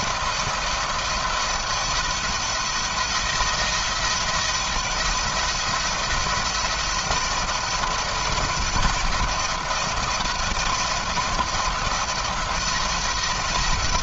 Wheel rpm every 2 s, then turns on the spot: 170, 160, 170, 170, 170, 170, 170.
none